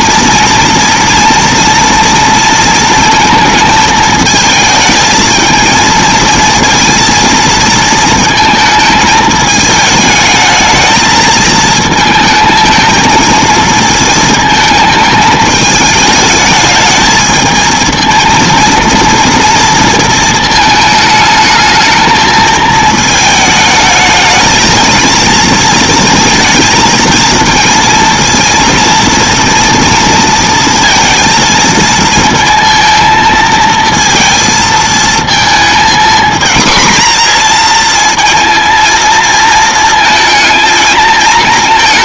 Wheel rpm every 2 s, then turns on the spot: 230, 230, 220, 220, 220, 220, 220, 220, 220, 230, 220, 220, 230, 230, 230, 230, 230, 230, 240, 230, 220.
none